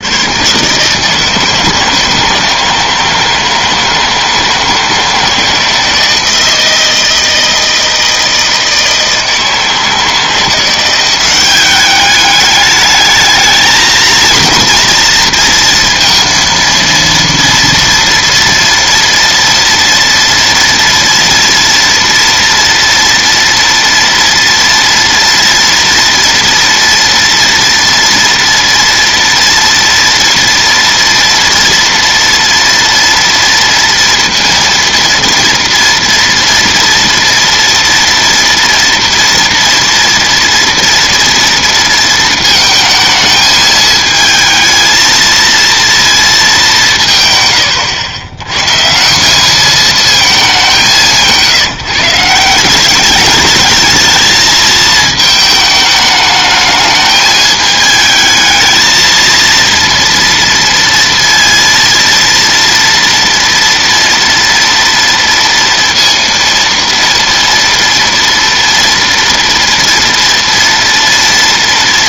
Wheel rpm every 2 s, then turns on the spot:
130, 170, 160, 160, 160, 170, 210, 230, 230, 230, 230, 230, 230, 230, 230, 240, 230, 230, 230, 230, 230, 220, 220, 190, 130, 190, 190, 220, 210, 220, 230, 230, 230, 230, 230, 230.
none